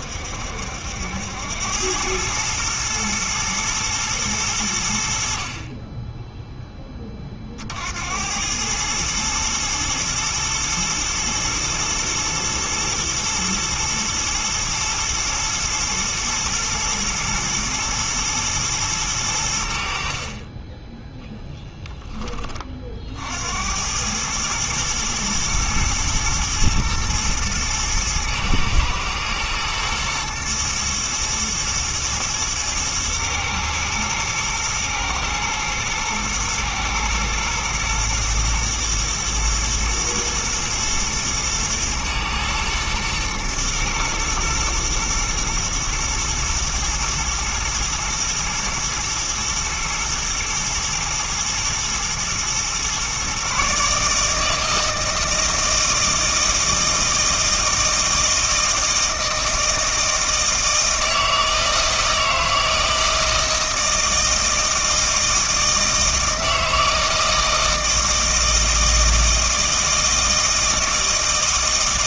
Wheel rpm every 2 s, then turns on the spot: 80, 110, 90, 10, 110, 110, 110, 120, 120, 110, 10, 40, 110, 110, 110, 120, 110, 110, 120, 120, 110, 110, 110, 110, 120, 120, 120, 160, 160, 160, 160, 160, 160, 160, 160, 160.
20-22